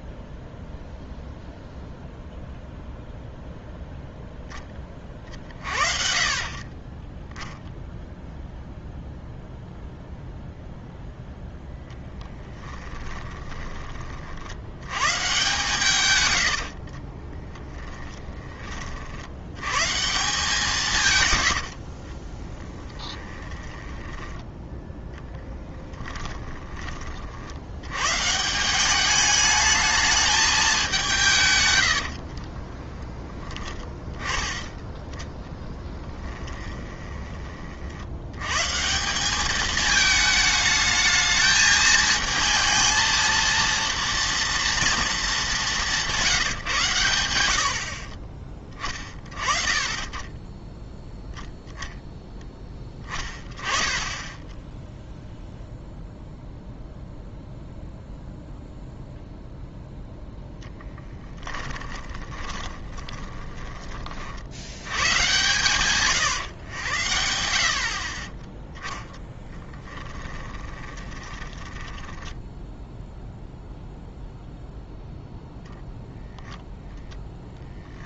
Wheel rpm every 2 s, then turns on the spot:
0, 0, 20, 20, 0, 0, 10, 100, 60, 30, 170, 10, 10, 20, 180, 200, 20, 20, 20, 150, 220, 230, 240, 140, 20, 10, 10, 10, 0, 0, 0, 20, 90, 100, 10, 20, 10, 0, 0.
12-14 16-18 22-24 32-38 62-64 68-72